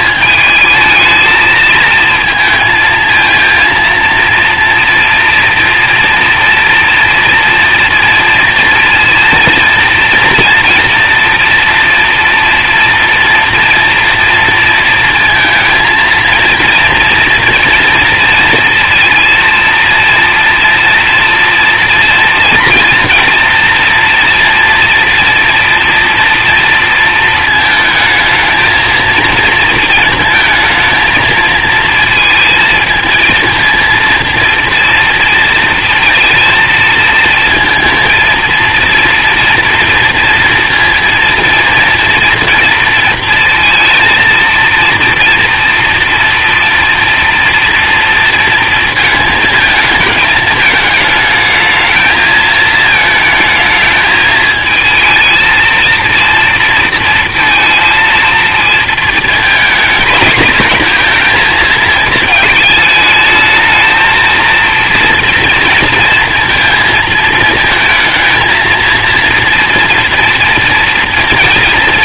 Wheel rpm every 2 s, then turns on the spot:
220, 220, 230, 230, 230, 230, 230, 230, 230, 230, 230, 230, 230, 230, 220, 230, 220, 230, 230, 230, 230, 230, 230, 230, 230, 220, 220, 220, 230, 230, 230, 220, 230, 230, 230, 230.
none